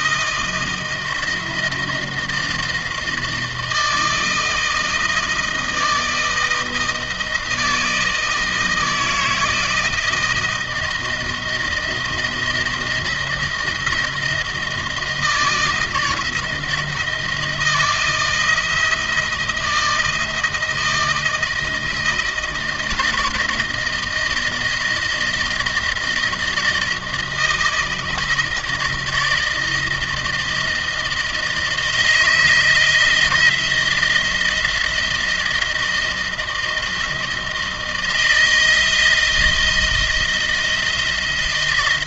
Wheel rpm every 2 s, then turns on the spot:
160, 160, 160, 160, 160, 160, 170, 160, 160, 170, 160, 160, 160, 160, 160, 160, 160, 170, 160, 160, 170.
none